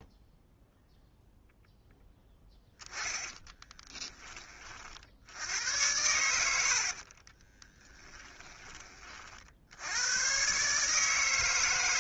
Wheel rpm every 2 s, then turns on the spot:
0, 10, 40, 70, 20, 140.
6-8